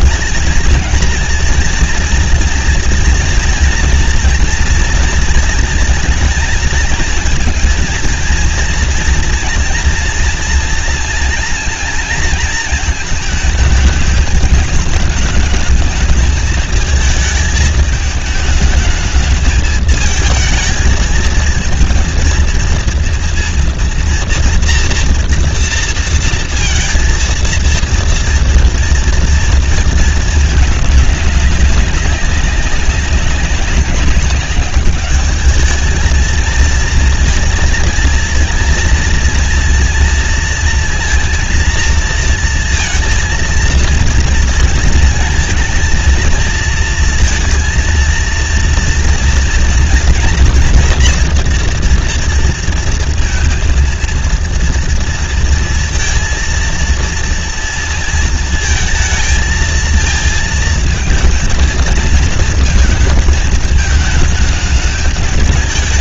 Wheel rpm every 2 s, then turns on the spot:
220, 230, 230, 220, 230, 230, 230, 210, 220, 210, 220, 230, 230, 230, 230, 220, 190, 200, 220, 230, 230, 230, 230, 230, 230, 230, 230, 230, 230, 230, 220, 230, 220.
none